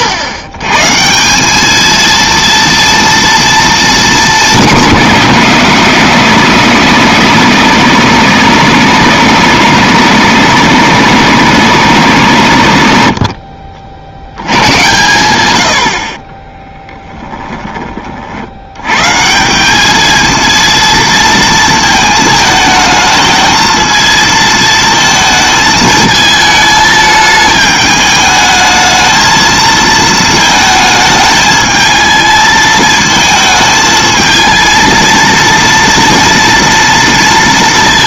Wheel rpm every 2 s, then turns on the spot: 130, 230, 180, 150, 150, 150, 80, 100, 10, 90, 230, 220, 220, 220, 220, 220, 220, 230, 230.
16-18